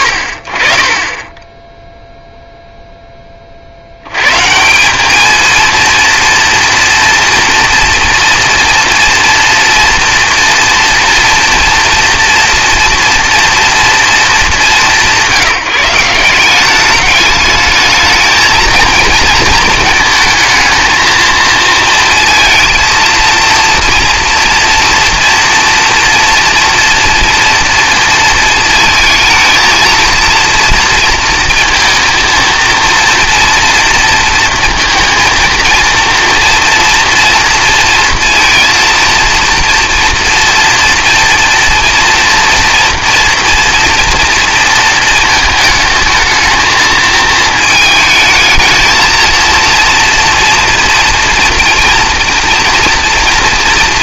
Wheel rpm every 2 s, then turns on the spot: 60, 0, 170, 230, 230, 240, 230, 200, 190, 220, 220, 230, 230, 230, 220, 230, 230, 230, 230, 230, 230, 230, 230, 220, 220, 240, 230.
none